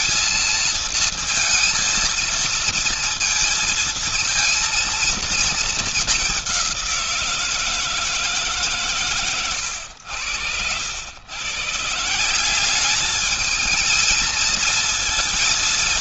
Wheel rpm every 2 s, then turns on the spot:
230, 230, 230, 190, 150, 100, 190, 220.
none